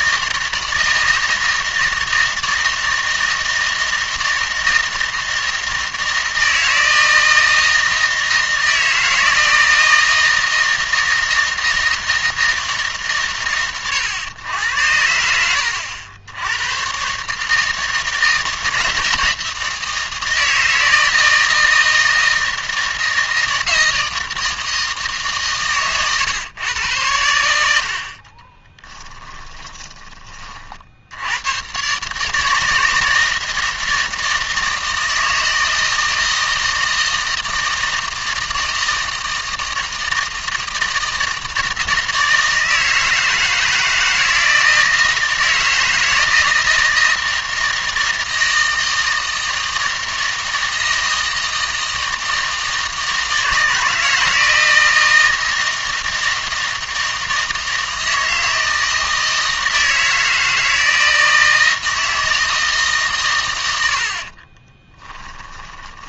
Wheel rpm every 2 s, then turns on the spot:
160, 160, 160, 160, 160, 160, 150, 90, 120, 160, 160, 160, 160, 100, 10, 60, 160, 160, 160, 160, 160, 160, 160, 160, 160, 160, 160, 160, 160, 160, 160, 160, 20.
28-30 64-66